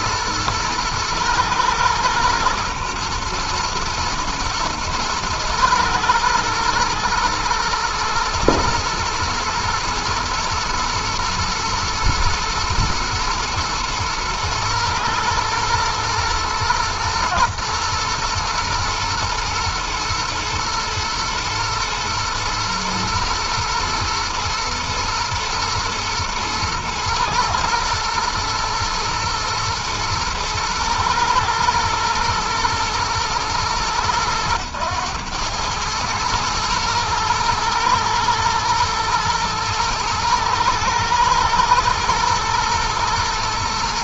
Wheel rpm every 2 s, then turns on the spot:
110, 120, 110, 110, 120, 120, 120, 110, 110, 120, 110, 110, 110, 120, 120, 110, 110, 110, 110, 110, 110, 110.
none